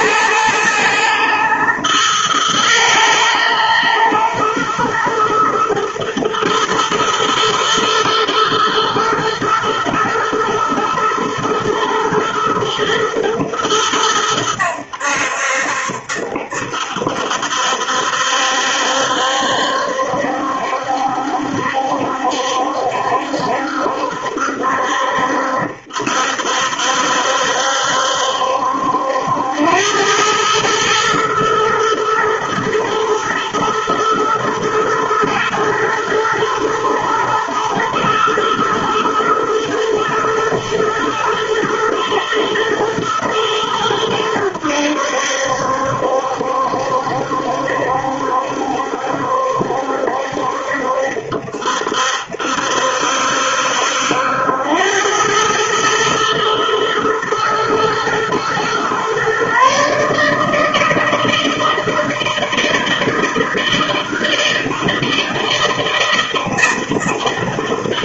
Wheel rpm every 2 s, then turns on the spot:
110, 110, 120, 110, 110, 110, 120, 90, 70, 70, 70, 70, 70, 70, 70, 110, 120, 110, 120, 110, 110, 110, 80, 70, 70, 70, 70, 90, 110, 120, 160, 160, 160, 160.
none